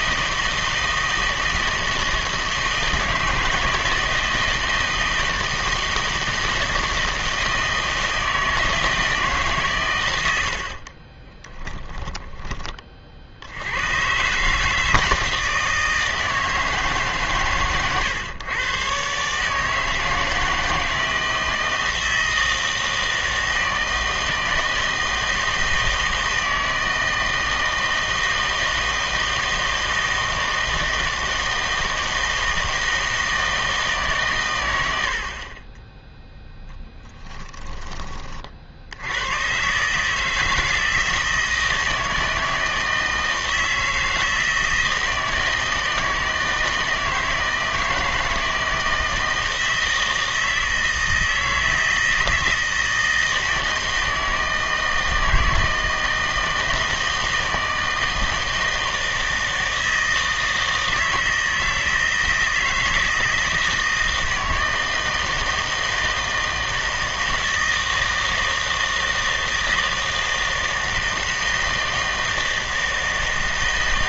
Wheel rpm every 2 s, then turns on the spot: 160, 160, 160, 160, 160, 60, 20, 150, 160, 120, 160, 160, 160, 160, 160, 160, 160, 100, 10, 60, 160, 160, 160, 160, 160, 160, 160, 160, 160, 160, 160, 160, 160, 160, 160, 160, 160.
10-12